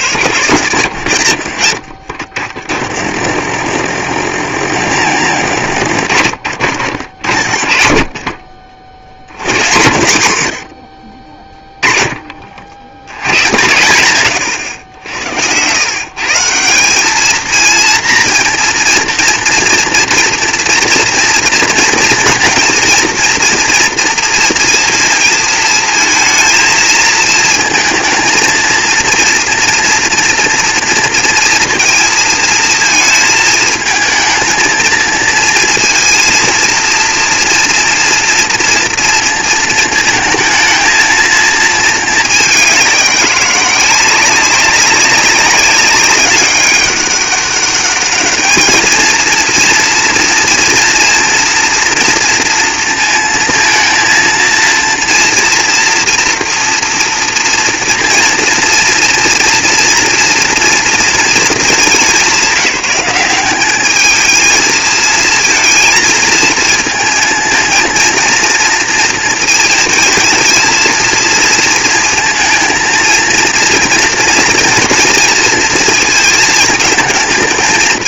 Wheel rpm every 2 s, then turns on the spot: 90, 40, 90, 70, 60, 70, 60, 90, 170, 230, 240, 230, 220, 220, 230, 230, 230, 230, 230, 230, 220, 200, 190, 200, 210, 230, 230, 230, 230, 240, 230, 180, 220, 230, 230, 230, 230, 230, 230.
none